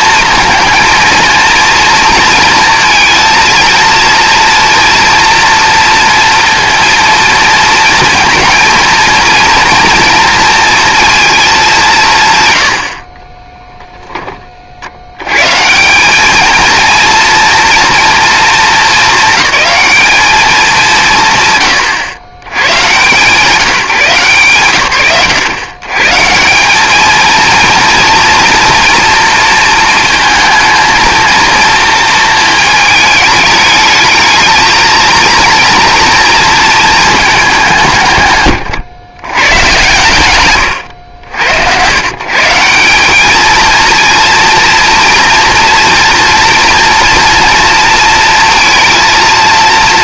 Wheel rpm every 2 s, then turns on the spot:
230, 230, 230, 230, 230, 240, 90, 50, 230, 220, 190, 120, 130, 190, 230, 220, 220, 230, 230, 120, 110, 180, 240, 230, 230.
none